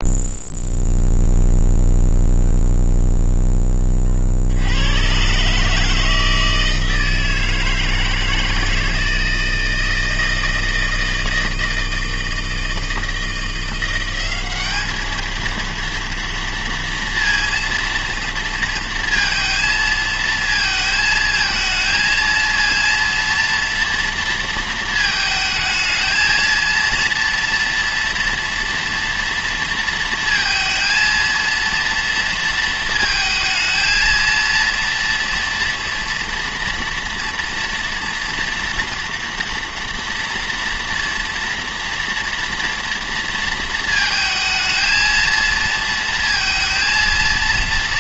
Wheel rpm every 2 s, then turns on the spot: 0, 0, 70, 160, 160, 160, 160, 200, 230, 230, 220, 230, 230, 220, 230, 230, 230, 230, 230, 240, 230, 240, 230, 230.
none